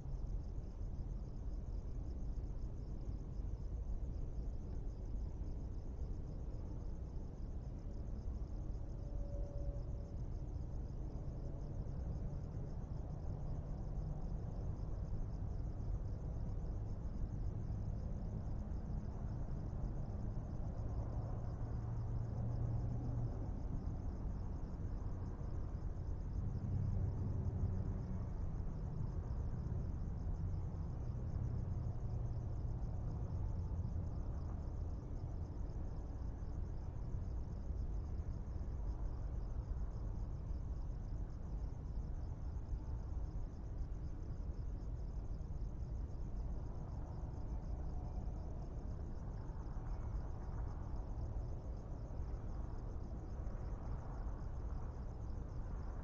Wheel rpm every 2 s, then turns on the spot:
0, 0, 0, 0, 0, 0, 0, 0, 0, 0, 0, 0, 0, 0, 0, 0, 0, 0, 0, 0, 0, 0, 0, 0, 0, 0, 0, 0.
none